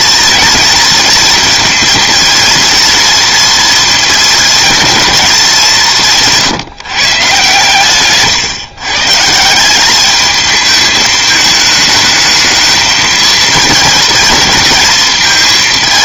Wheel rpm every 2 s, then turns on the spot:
230, 230, 230, 150, 150, 220, 220, 220.
none